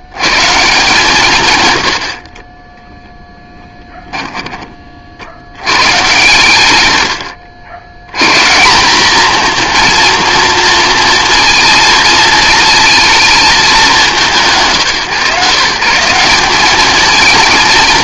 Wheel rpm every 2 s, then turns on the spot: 100, 20, 30, 90, 180, 230, 230, 120, 210.
none